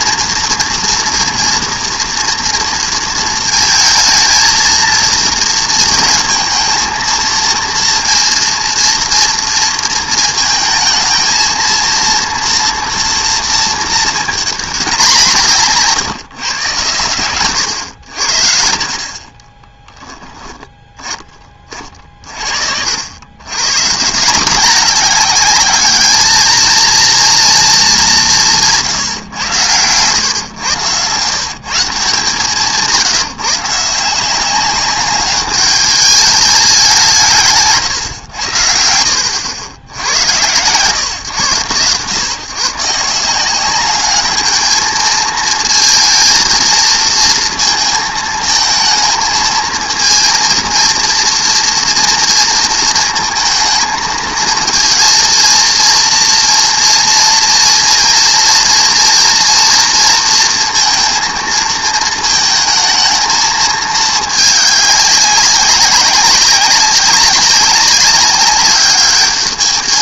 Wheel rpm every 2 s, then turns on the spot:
230, 230, 230, 230, 230, 220, 230, 200, 130, 60, 10, 60, 190, 230, 160, 110, 160, 190, 190, 70, 120, 150, 220, 230, 220, 230, 220, 230, 230, 230, 230, 220, 210, 190, 200.
28-30